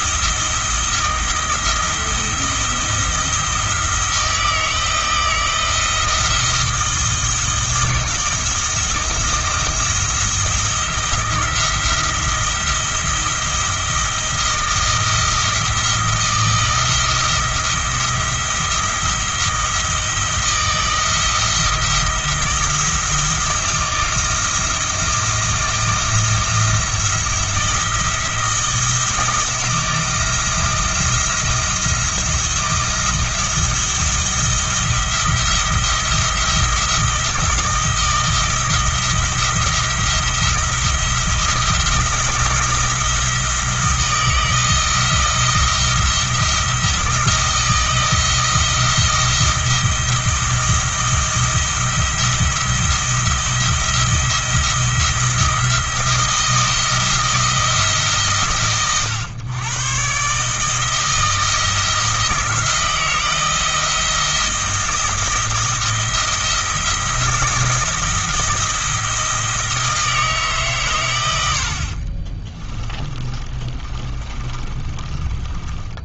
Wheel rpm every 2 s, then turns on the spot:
170, 170, 160, 160, 160, 170, 170, 160, 170, 170, 160, 170, 170, 170, 170, 170, 170, 170, 170, 170, 170, 170, 170, 170, 170, 170, 170, 170, 160, 120, 160, 160, 170, 160, 170, 130, 30, 30.
72-76